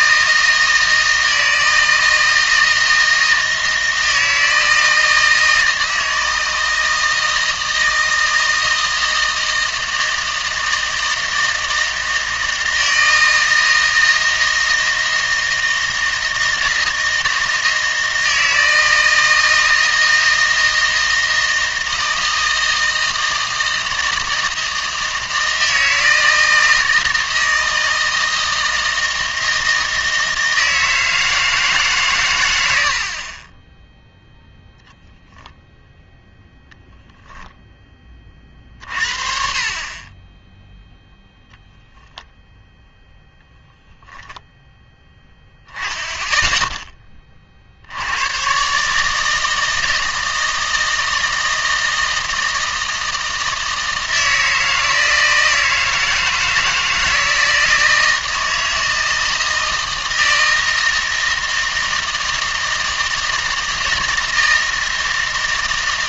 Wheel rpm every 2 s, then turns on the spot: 160, 160, 160, 160, 160, 160, 160, 160, 160, 160, 160, 160, 160, 160, 160, 160, 90, 0, 0, 40, 0, 0, 0, 10, 140, 160, 160, 160, 160, 160, 160, 160, 160.
none